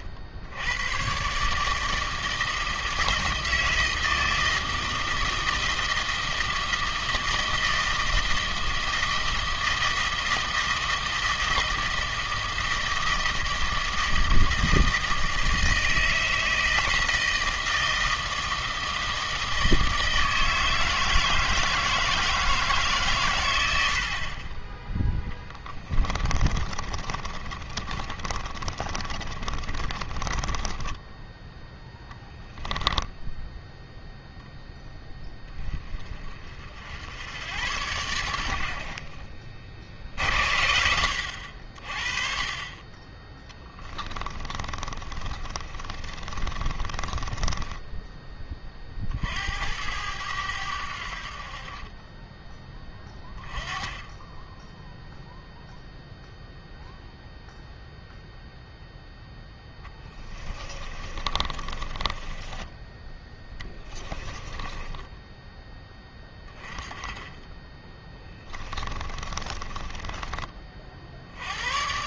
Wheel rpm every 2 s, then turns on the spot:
70, 160, 160, 160, 160, 160, 160, 160, 160, 160, 160, 150, 20, 30, 30, 20, 10, 0, 60, 80, 70, 30, 30, 30, 30, 90, 10, 10, 0, 0, 20, 10, 20, 20, 20, 30.
26-32 44-48 60-66 68-70